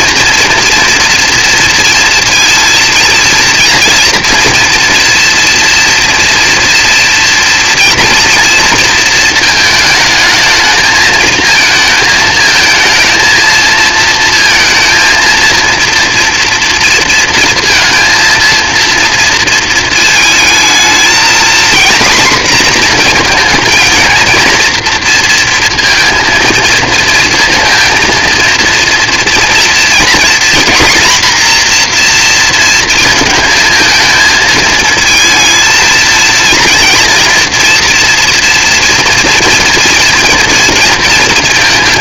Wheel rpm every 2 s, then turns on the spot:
230, 230, 240, 230, 230, 220, 220, 230, 230, 230, 220, 240, 230, 230, 230, 240, 230, 220, 230, 240, 230.
none